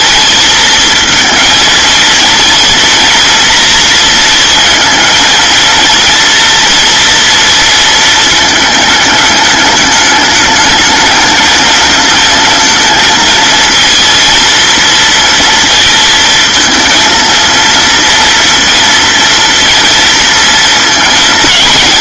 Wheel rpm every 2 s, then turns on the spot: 230, 230, 230, 230, 220, 220, 220, 230, 220, 230, 230.
none